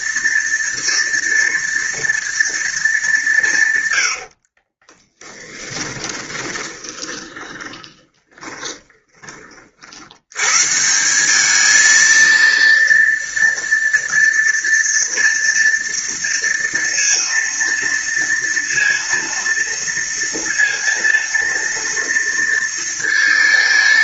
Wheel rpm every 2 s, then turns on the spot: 230, 220, 40, 20, 20, 130, 230, 230, 230, 230, 230, 230.
4-10